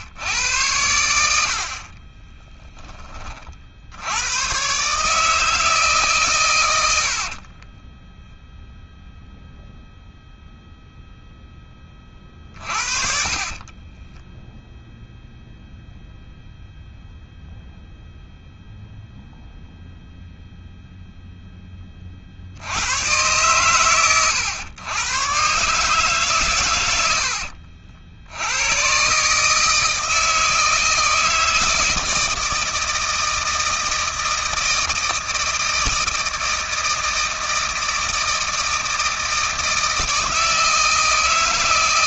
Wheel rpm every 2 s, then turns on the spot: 90, 40, 150, 70, 0, 0, 40, 0, 0, 0, 0, 110, 120, 100, 130, 160, 160, 160, 160, 160, 160.
6-8 12-14